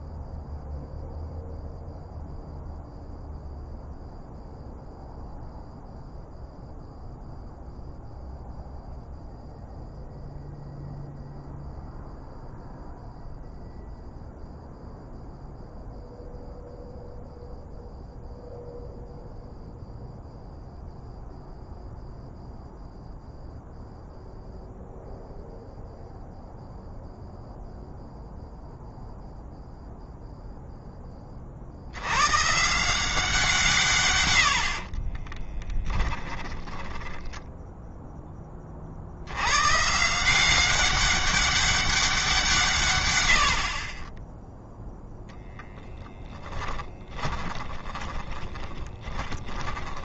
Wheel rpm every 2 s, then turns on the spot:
0, 0, 0, 0, 0, 0, 0, 0, 0, 0, 0, 0, 0, 0, 0, 10, 160, 40, 10, 40, 190, 120, 0, 10, 20.
34-38 46-50